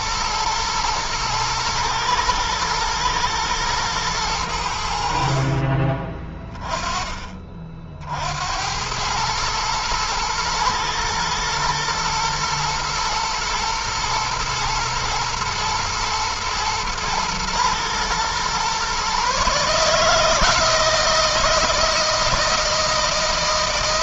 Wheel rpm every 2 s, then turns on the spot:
120, 110, 80, 20, 100, 120, 110, 110, 110, 130, 160, 160.
none